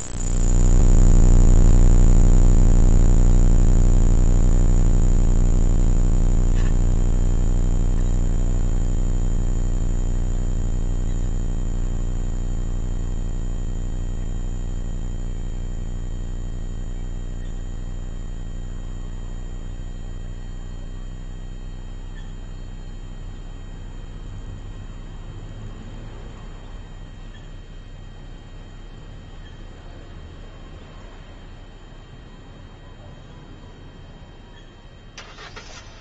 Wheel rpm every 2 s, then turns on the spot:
0, 0, 0, 0, 20, 10, 0, 0, 0, 0, 0, 0, 0, 0, 0, 0, 0, 0.
none